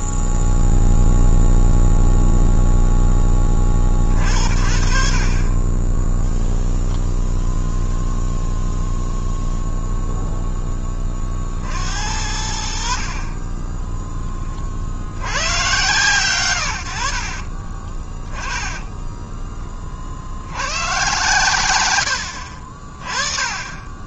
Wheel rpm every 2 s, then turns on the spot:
0, 0, 50, 10, 0, 0, 70, 30, 110, 20, 100, 50.
none